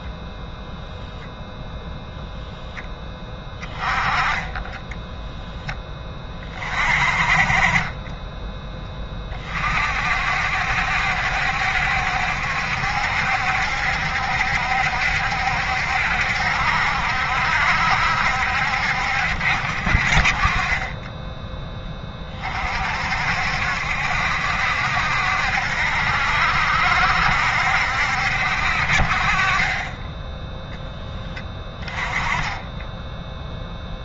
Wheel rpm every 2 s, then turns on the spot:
0, 0, 10, 40, 10, 60, 70, 70, 60, 60, 20, 40, 70, 70, 50, 0, 10.
4-6